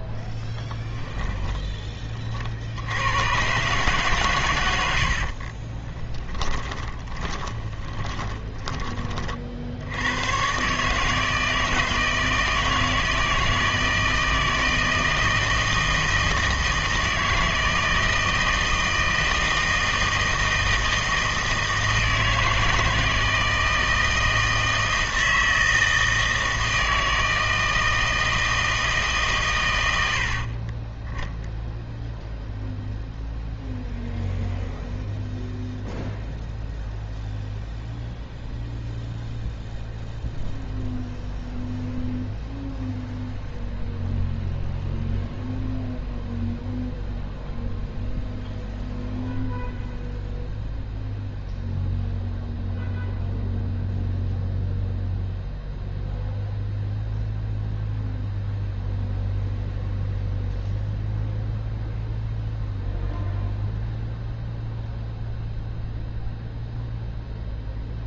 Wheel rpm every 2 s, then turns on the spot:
10, 70, 100, 20, 30, 130, 160, 160, 160, 160, 160, 160, 160, 160, 160, 40, 0, 0, 0, 0, 0, 0, 0, 0, 0, 0, 0, 0, 0, 0, 0, 0, 0, 0.
6-10